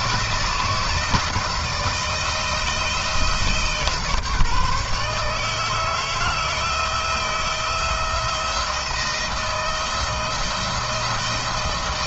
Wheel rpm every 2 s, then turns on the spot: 160, 160, 150, 160, 170, 170.
none